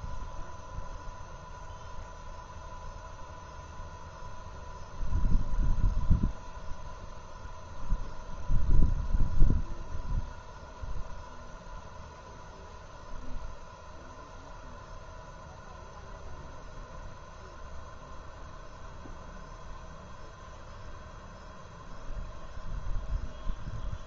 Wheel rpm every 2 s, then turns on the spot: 0, 0, 0, 0, 0, 0, 0, 0, 0, 0, 0, 0.
none